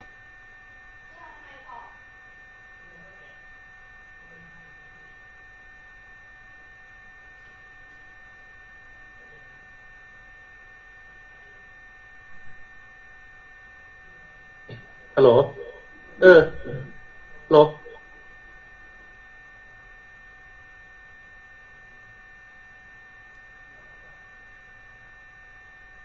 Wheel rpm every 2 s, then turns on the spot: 0, 0, 0, 0, 0, 0, 0, 0, 0, 0, 0, 0, 0.
none